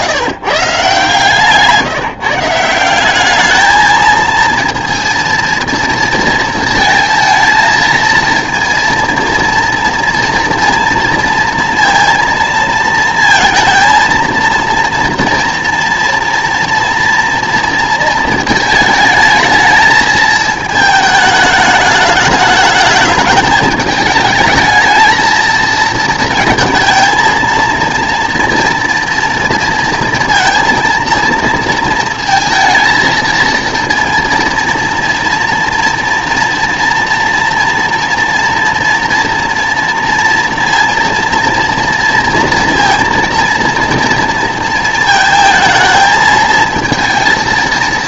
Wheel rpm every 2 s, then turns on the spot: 150, 180, 230, 230, 230, 230, 220, 230, 230, 220, 220, 210, 220, 230, 230, 230, 230, 230, 230, 240, 230, 230, 220, 230.
none